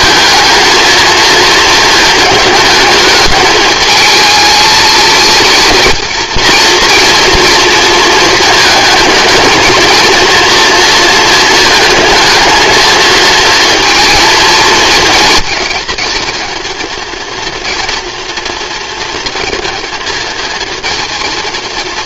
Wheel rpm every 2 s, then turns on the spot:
230, 210, 220, 230, 220, 230, 220, 230, 230, 230, 230.
none